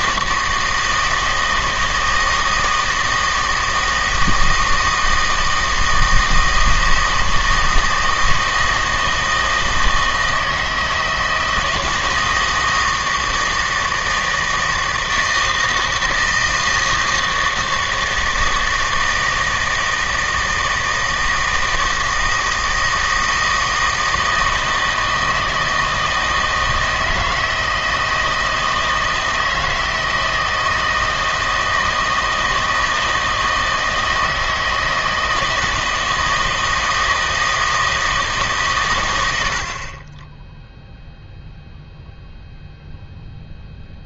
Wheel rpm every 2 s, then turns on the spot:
160, 160, 160, 160, 160, 160, 160, 160, 160, 160, 160, 160, 160, 160, 160, 160, 160, 160, 160, 130, 0, 0.
none